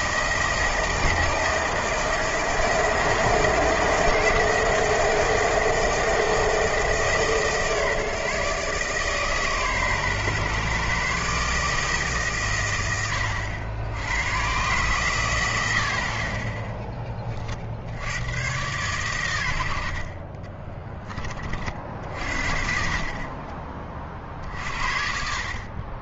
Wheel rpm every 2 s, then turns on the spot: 160, 160, 160, 160, 140, 130, 100, 130, 20, 120, 20, 50, 60.
20-22